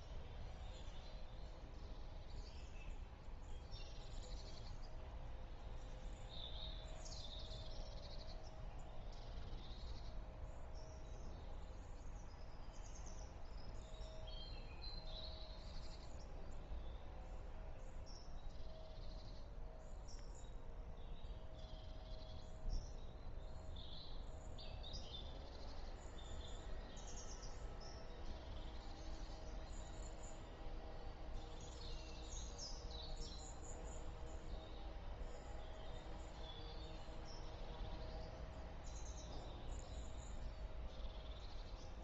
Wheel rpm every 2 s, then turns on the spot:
0, 0, 0, 0, 0, 0, 0, 0, 0, 0, 0, 0, 0, 0, 0, 0, 0, 0, 0, 0, 0.
none